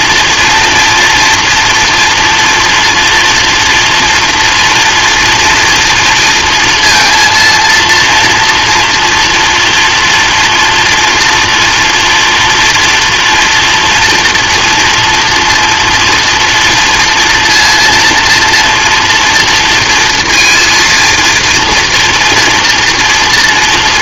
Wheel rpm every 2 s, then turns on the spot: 230, 240, 230, 230, 230, 240, 230, 230, 230, 230, 230, 230.
none